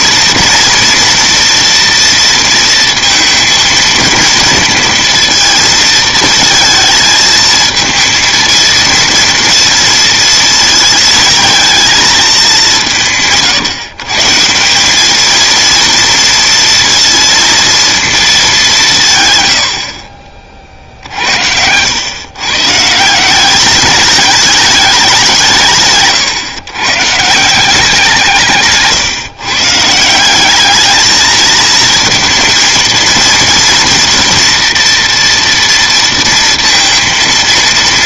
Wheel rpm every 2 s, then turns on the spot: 230, 230, 230, 220, 230, 230, 200, 170, 230, 200, 40, 140, 210, 130, 160, 200, 230, 230, 230.
none